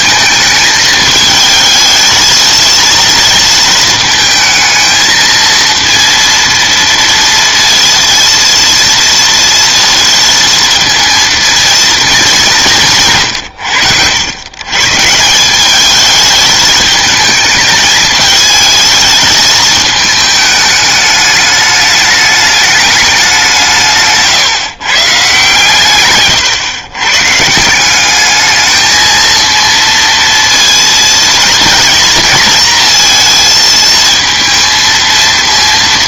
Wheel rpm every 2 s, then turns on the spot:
220, 230, 220, 230, 230, 230, 160, 140, 210, 220, 210, 210, 140, 120, 220, 230, 230, 230.
none